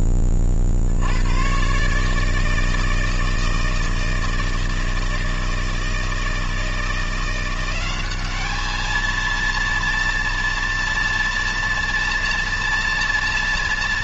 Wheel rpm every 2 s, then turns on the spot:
40, 160, 160, 160, 210, 230, 240.
none